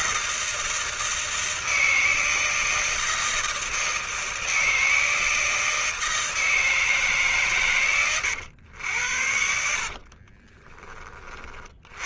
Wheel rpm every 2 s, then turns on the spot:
170, 160, 160, 160, 120, 40.
10-12